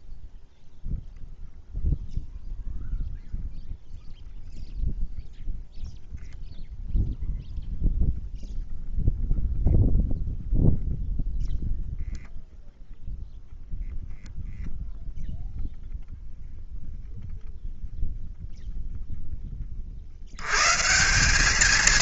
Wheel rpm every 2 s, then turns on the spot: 0, 0, 0, 0, 0, 0, 0, 0, 0, 10, 170.
none